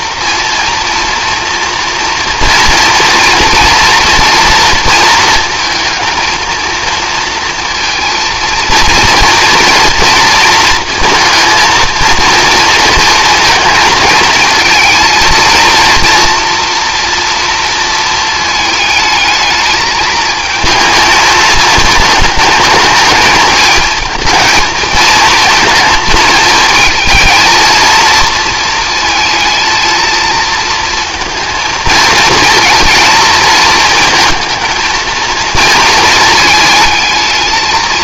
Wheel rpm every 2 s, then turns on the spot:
230, 230, 230, 230, 230, 230, 230, 230, 230, 220, 220, 220, 220, 220, 230, 230, 230, 230, 220.
none